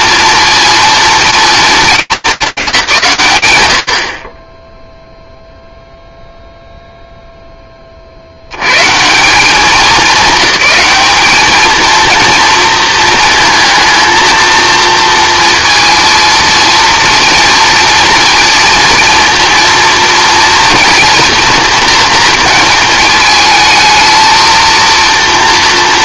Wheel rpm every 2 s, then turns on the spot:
230, 210, 20, 0, 120, 210, 230, 230, 230, 230, 230, 220, 230.
none